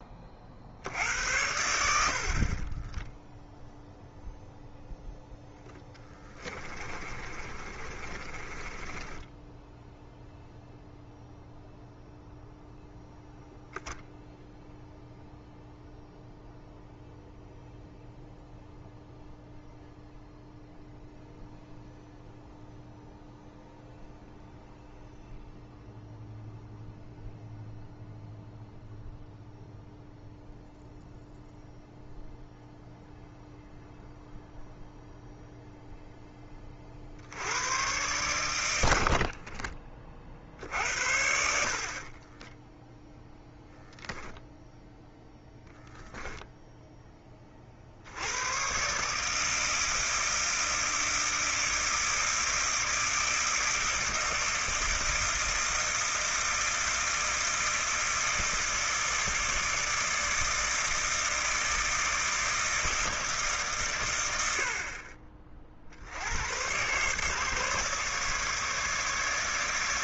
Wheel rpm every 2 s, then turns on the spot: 70, 20, 0, 30, 20, 0, 0, 0, 0, 0, 0, 0, 0, 0, 0, 0, 0, 0, 40, 80, 60, 0, 0, 10, 130, 160, 160, 160, 160, 160, 160, 160, 50, 120, 150.
2-4 6-10